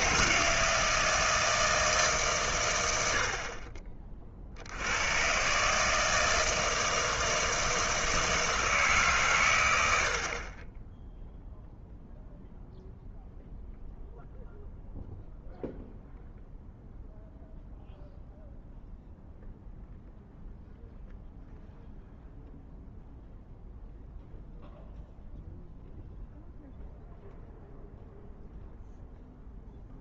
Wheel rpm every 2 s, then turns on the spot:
160, 110, 70, 160, 160, 20, 0, 0, 0, 0, 0, 0, 0, 0, 0.
none